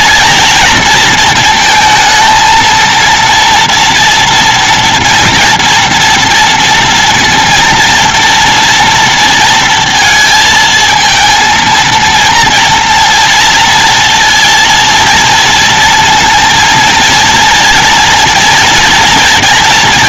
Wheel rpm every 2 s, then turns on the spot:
230, 220, 240, 230, 240, 230, 230, 230, 230, 230.
none